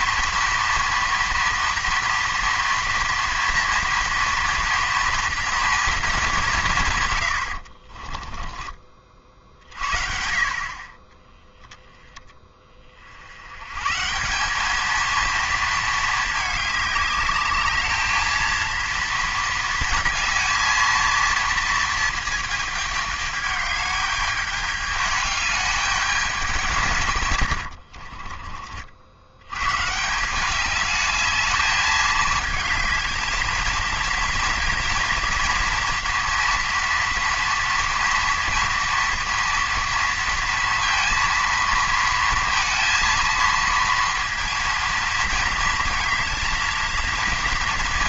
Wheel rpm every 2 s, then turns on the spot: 230, 230, 230, 180, 20, 30, 30, 200, 210, 230, 220, 220, 210, 180, 50, 200, 220, 230, 230, 230, 230, 230, 220, 220.
none